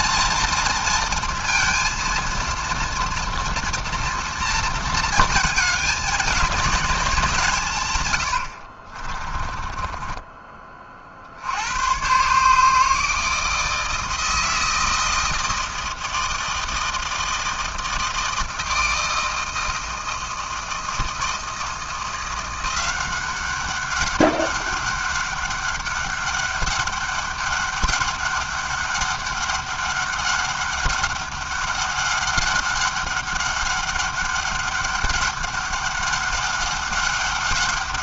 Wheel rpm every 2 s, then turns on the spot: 230, 230, 230, 210, 60, 30, 150, 160, 160, 160, 170, 180, 200, 200, 200, 200, 200, 200, 200.
8-10